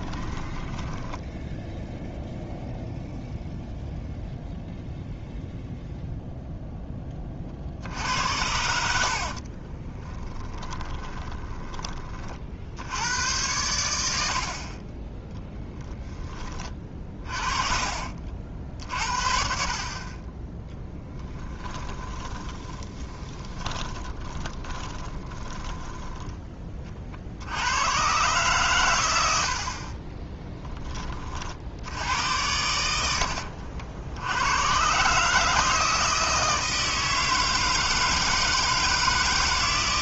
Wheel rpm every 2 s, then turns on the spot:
10, 0, 0, 10, 70, 20, 60, 40, 30, 60, 10, 10, 30, 30, 120, 20, 80, 120, 160, 160.
0-2 10-12 14-18 20-26